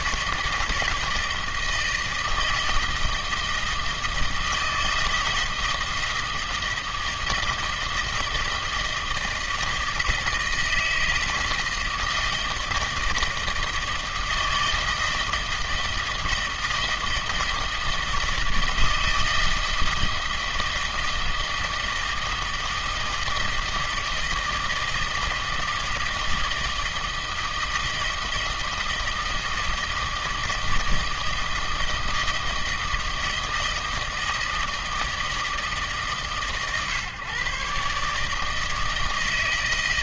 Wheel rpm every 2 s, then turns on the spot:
160, 160, 160, 160, 160, 160, 160, 160, 160, 160, 160, 160, 160, 160, 160, 160, 160, 160, 140, 160.
none